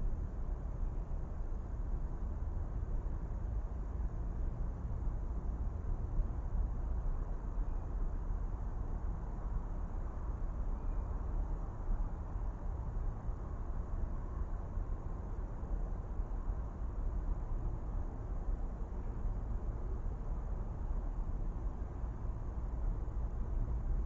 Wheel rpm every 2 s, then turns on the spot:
0, 0, 0, 0, 0, 0, 0, 0, 0, 0, 0, 0.
none